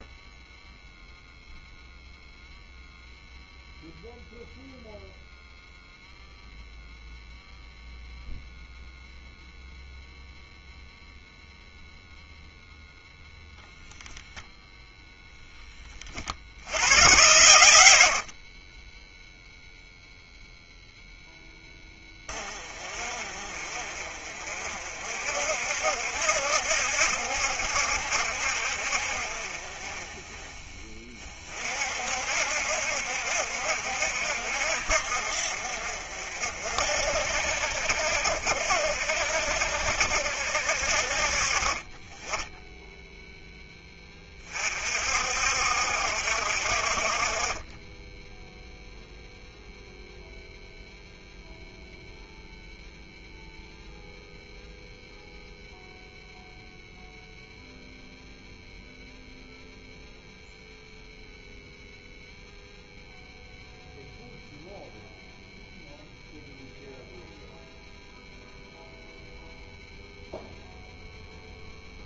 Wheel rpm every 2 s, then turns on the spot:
0, 0, 0, 0, 0, 0, 0, 0, 90, 30, 0, 30, 50, 70, 60, 20, 70, 60, 60, 60, 60, 10, 40, 50, 0, 0, 0, 0, 0, 0, 0, 0, 0, 0, 0, 0.
none